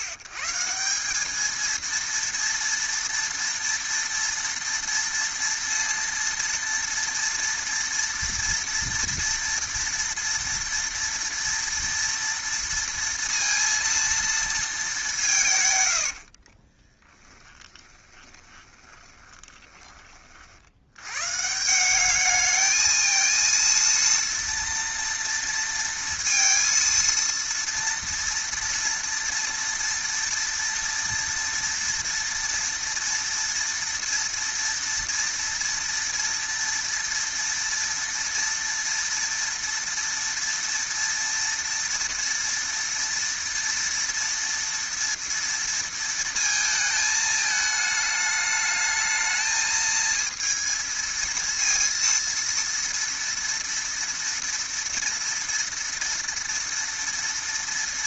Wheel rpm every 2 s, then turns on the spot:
140, 230, 230, 230, 240, 230, 230, 230, 50, 20, 50, 210, 230, 230, 230, 230, 230, 230, 230, 230, 230, 230, 230, 220, 210, 230, 230, 230, 230.
16-20